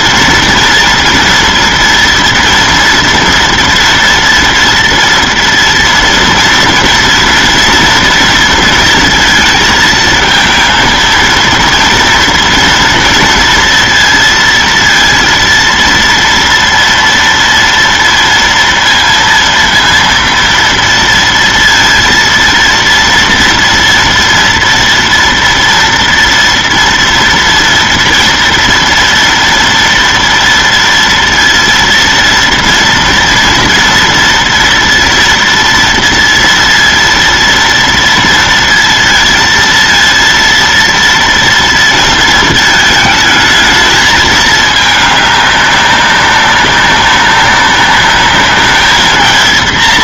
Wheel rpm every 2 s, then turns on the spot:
230, 230, 230, 230, 230, 230, 230, 230, 230, 230, 230, 230, 230, 240, 230, 230, 230, 230, 230, 230, 230, 220, 210, 200, 210.
none